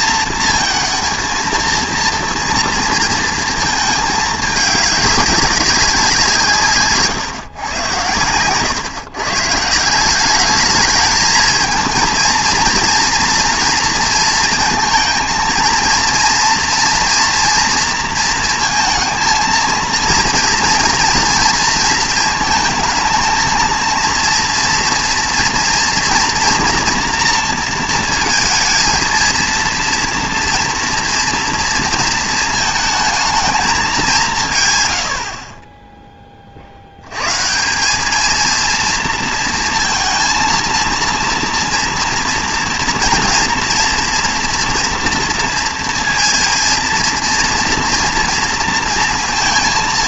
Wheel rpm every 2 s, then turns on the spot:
230, 230, 210, 130, 130, 210, 230, 230, 240, 230, 230, 220, 230, 230, 230, 230, 220, 120, 50, 230, 230, 240, 240, 230, 230.
none